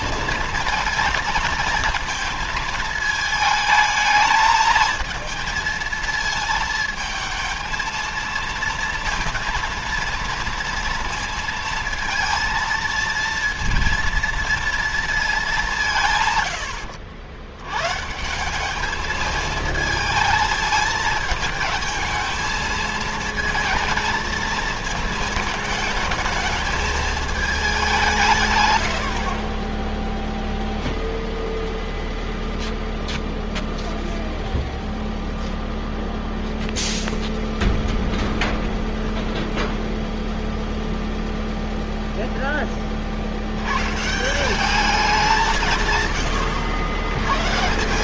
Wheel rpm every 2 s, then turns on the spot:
230, 220, 220, 220, 230, 230, 230, 220, 80, 210, 220, 230, 220, 220, 100, 0, 0, 0, 0, 0, 0, 20, 180, 100.
16-18